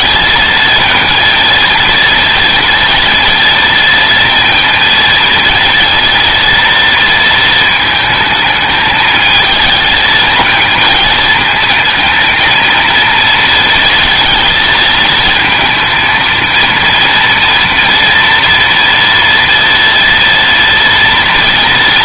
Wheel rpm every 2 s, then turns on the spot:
230, 230, 230, 230, 220, 220, 230, 230, 230, 230, 230.
none